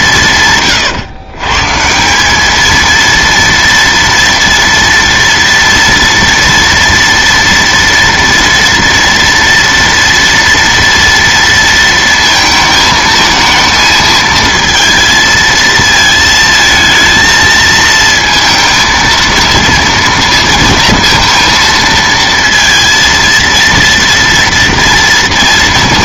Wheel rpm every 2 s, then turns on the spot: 140, 210, 230, 230, 230, 230, 220, 220, 220, 230, 230, 230, 230.
none